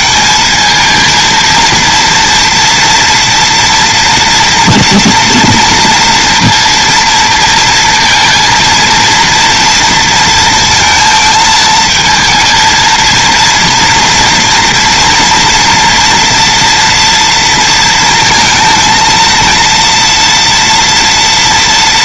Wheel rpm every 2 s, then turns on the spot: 220, 230, 240, 230, 230, 230, 230, 230, 230, 230, 230.
none